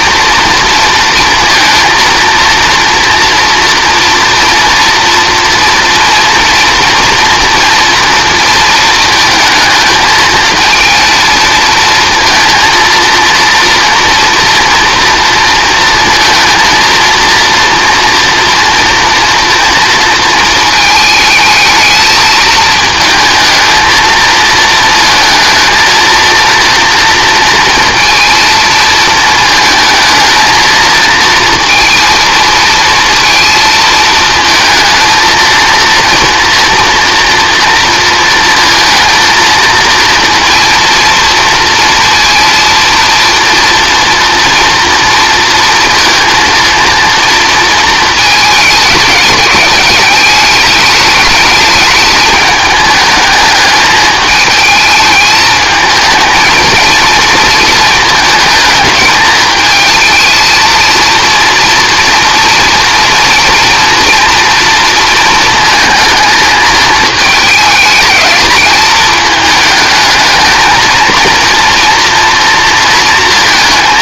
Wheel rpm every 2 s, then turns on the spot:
230, 230, 230, 230, 230, 220, 230, 230, 230, 230, 220, 220, 220, 230, 230, 220, 230, 220, 230, 220, 230, 230, 240, 230, 210, 210, 210, 220, 230, 220, 230, 230, 240, 220, 220, 230, 230.
none